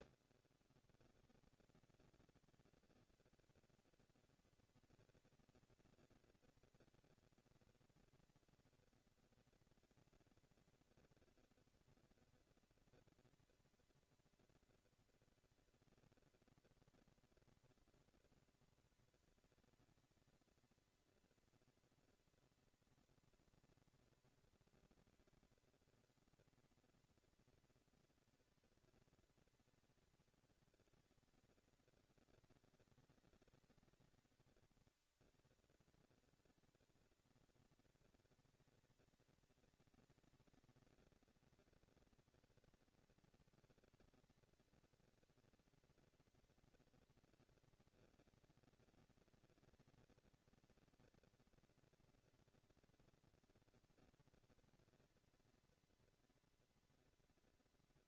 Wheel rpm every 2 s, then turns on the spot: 170, 230, 230, 230, 230, 230, 230, 230, 230, 230, 230, 230, 230, 230, 220, 200, 200, 210, 220, 230, 230, 230, 230, 240, 230, 230, 230, 230, 230.
none